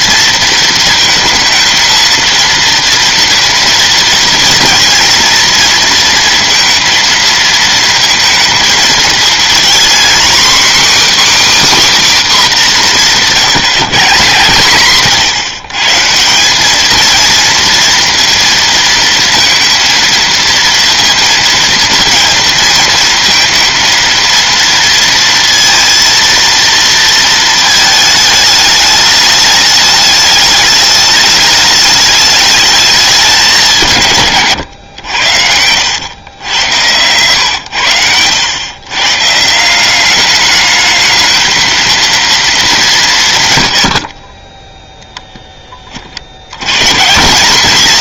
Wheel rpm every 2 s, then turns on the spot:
230, 230, 230, 230, 220, 270, 240, 140, 180, 230, 230, 230, 230, 230, 210, 210, 210, 120, 100, 110, 210, 200, 10, 100.
none